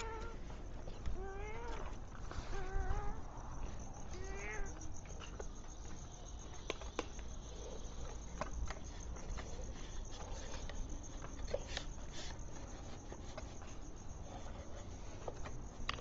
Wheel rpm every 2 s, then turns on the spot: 0, 0, 0, 0, 0, 0, 0, 0.
none